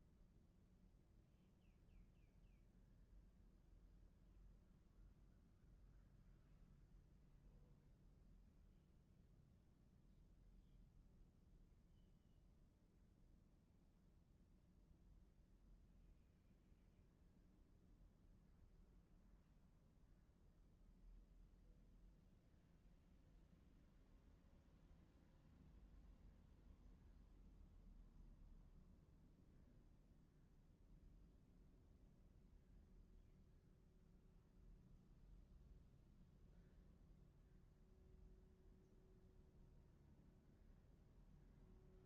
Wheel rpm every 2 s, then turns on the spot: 0, 0, 0, 0, 0, 0, 0, 0, 0, 0, 0, 0, 0, 0, 0, 0, 0, 0, 0, 0, 0.
none